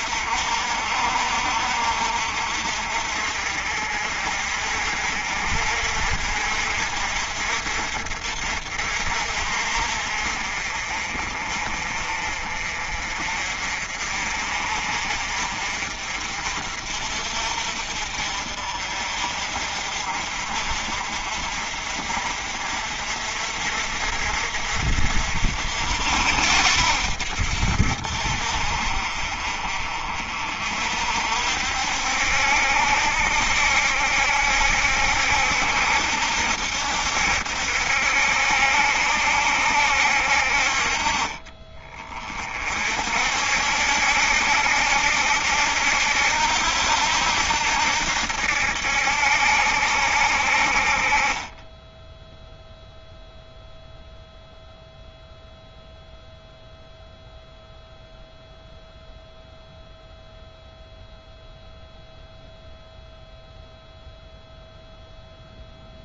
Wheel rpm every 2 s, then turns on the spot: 50, 50, 50, 50, 50, 40, 40, 50, 50, 50, 50, 50, 60, 70, 50, 50, 70, 70, 70, 70, 50, 50, 70, 80, 70, 40, 0, 0, 0, 0, 0, 0, 0.
none